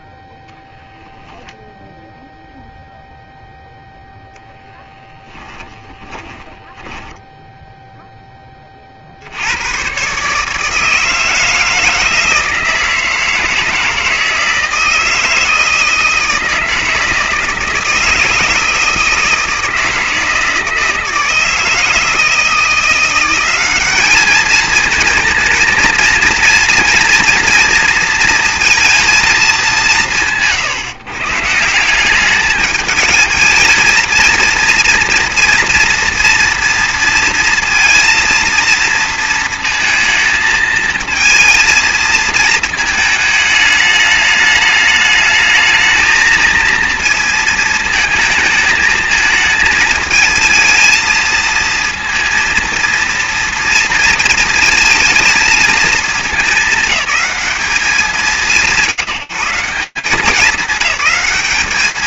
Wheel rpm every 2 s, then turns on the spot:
0, 0, 10, 10, 130, 160, 160, 160, 160, 160, 160, 200, 230, 230, 130, 180, 230, 240, 230, 230, 220, 210, 220, 220, 220, 230, 230, 210, 180, 170, 200.
4-6